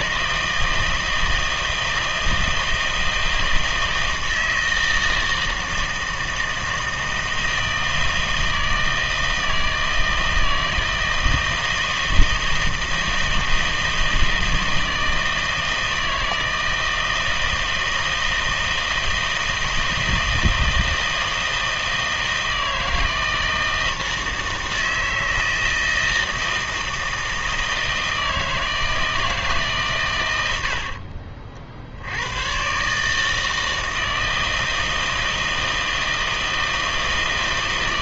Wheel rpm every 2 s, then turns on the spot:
160, 160, 160, 160, 160, 160, 160, 160, 160, 160, 160, 160, 160, 160, 160, 60, 130, 160, 160.
30-32